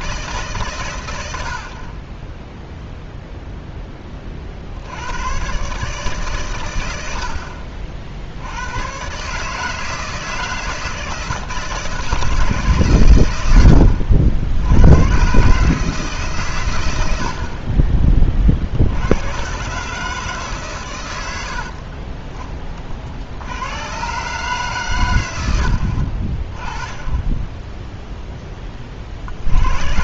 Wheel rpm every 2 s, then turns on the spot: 110, 0, 90, 90, 120, 160, 130, 100, 90, 80, 100, 50, 120, 20, 40.
none